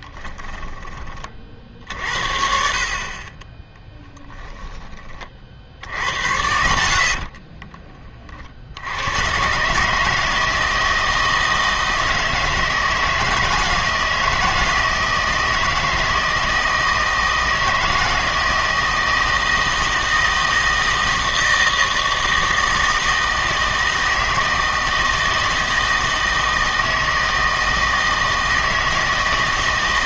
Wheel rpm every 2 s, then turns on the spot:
10, 50, 10, 70, 70, 160, 160, 160, 160, 170, 160, 160, 160, 160, 160.
none